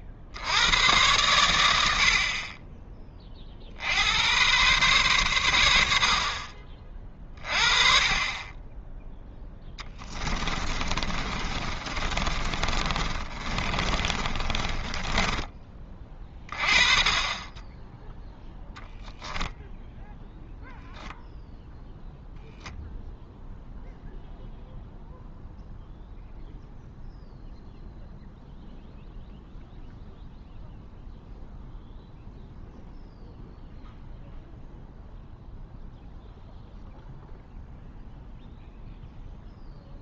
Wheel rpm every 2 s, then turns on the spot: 100, 20, 120, 40, 10, 30, 40, 20, 30, 10, 0, 0, 0, 0, 0, 0, 0, 0, 0, 0.
10-16